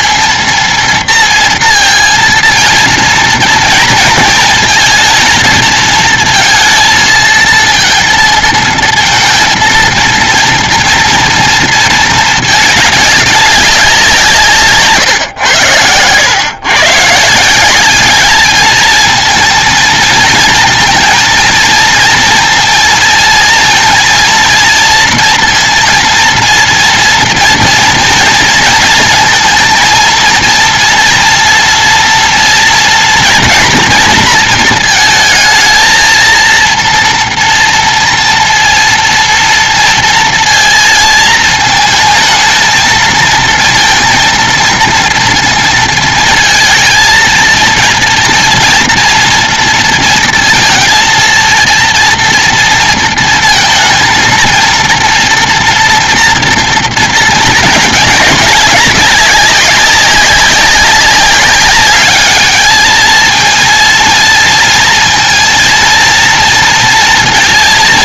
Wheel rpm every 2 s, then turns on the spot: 230, 230, 230, 230, 230, 230, 220, 170, 100, 200, 230, 230, 230, 230, 230, 230, 240, 230, 230, 230, 230, 220, 230, 220, 230, 230, 230, 230, 240, 200, 190, 200, 230, 230.
none